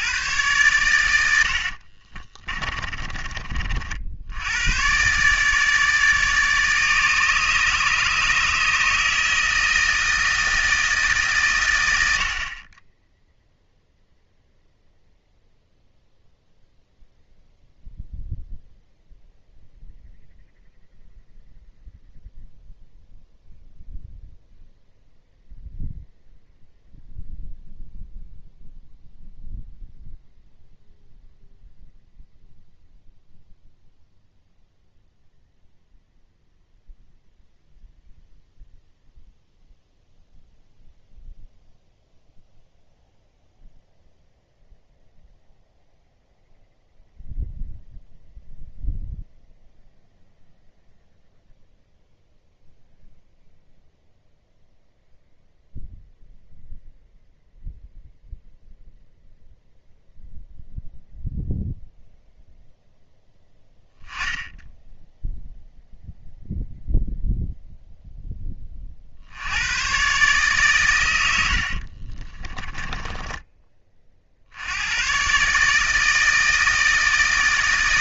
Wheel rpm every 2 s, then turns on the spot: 110, 20, 100, 150, 160, 160, 30, 0, 0, 0, 0, 0, 0, 0, 0, 0, 0, 0, 0, 0, 0, 0, 0, 0, 0, 0, 0, 0, 0, 0, 0, 0, 10, 0, 20, 130, 20, 80, 160.
2-4 72-74